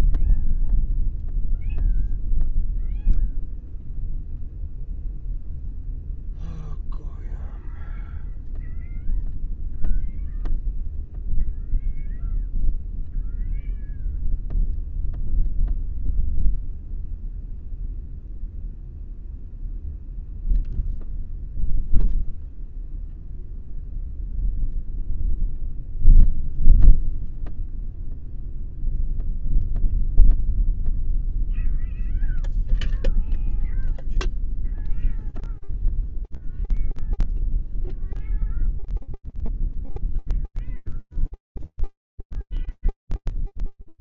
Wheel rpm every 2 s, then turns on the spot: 0, 0, 0, 0, 0, 0, 0, 0, 0, 0, 0, 0, 0, 0, 0, 0, 0, 0, 0, 0, 0, 0.
none